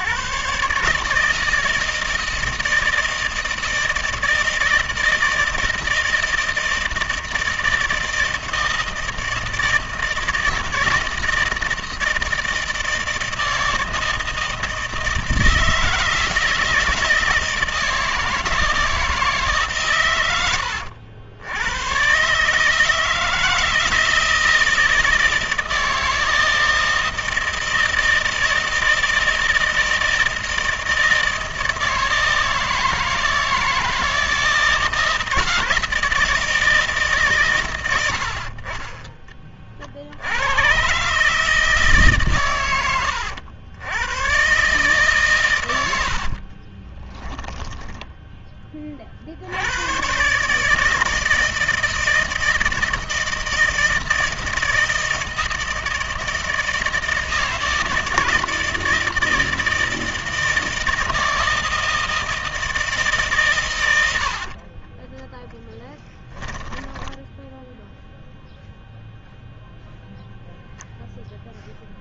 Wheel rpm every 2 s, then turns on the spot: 140, 160, 160, 160, 160, 160, 160, 160, 160, 160, 90, 150, 160, 160, 160, 160, 160, 160, 160, 40, 90, 120, 140, 40, 10, 140, 160, 160, 160, 160, 160, 160, 30, 10, 0, 0.
46-48 64-68